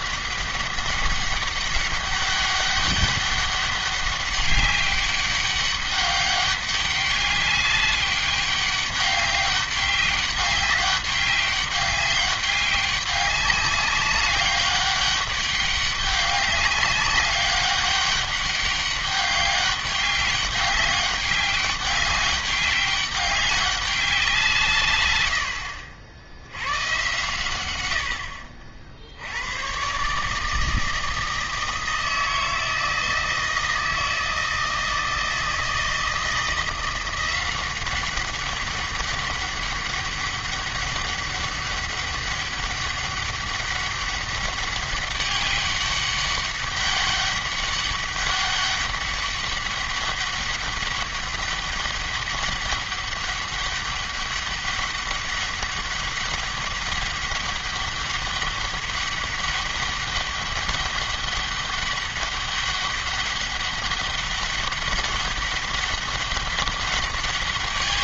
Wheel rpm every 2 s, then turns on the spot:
200, 200, 200, 200, 200, 200, 200, 200, 200, 200, 200, 200, 150, 90, 60, 160, 160, 160, 170, 200, 200, 200, 200, 200, 200, 200, 200, 200, 200, 200, 200, 200, 200, 200.
none